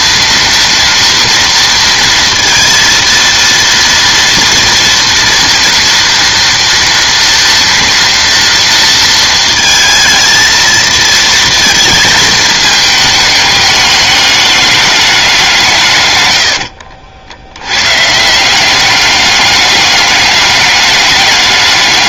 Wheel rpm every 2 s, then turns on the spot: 230, 230, 240, 230, 230, 220, 210, 210, 80, 180, 200.
16-18